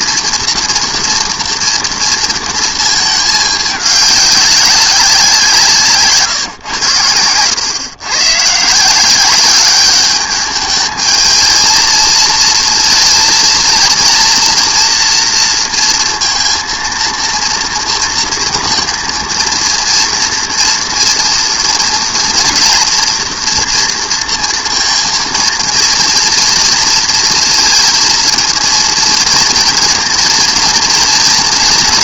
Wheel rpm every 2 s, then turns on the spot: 230, 230, 200, 120, 150, 210, 230, 240, 230, 230, 230, 230, 230, 240, 230, 230.
none